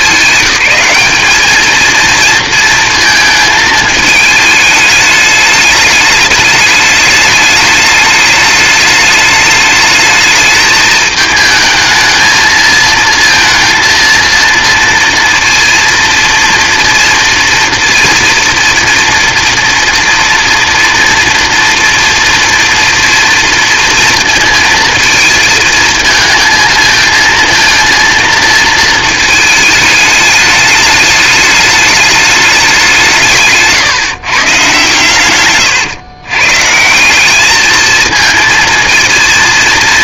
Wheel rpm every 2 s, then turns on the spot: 200, 230, 210, 210, 210, 210, 220, 230, 230, 230, 230, 230, 230, 220, 220, 210, 190, 120, 150, 230.
none